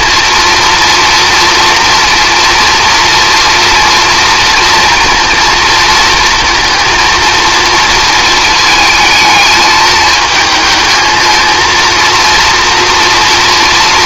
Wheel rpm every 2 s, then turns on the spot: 230, 240, 230, 230, 220, 220, 230.
none